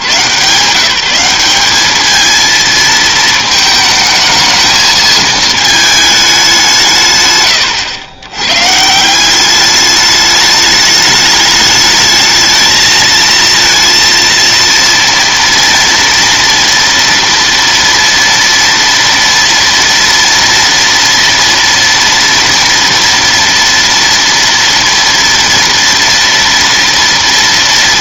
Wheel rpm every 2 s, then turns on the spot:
160, 230, 220, 160, 140, 210, 220, 230, 230, 230, 230, 230, 230, 230.
none